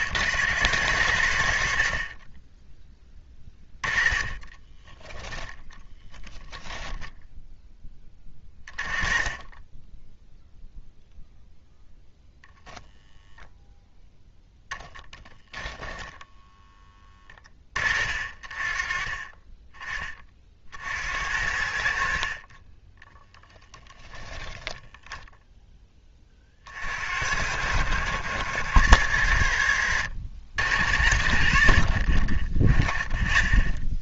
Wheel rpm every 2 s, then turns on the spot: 90, 10, 10, 10, 20, 0, 0, 10, 10, 30, 60, 20, 10, 50, 90, 70, 20.
4-8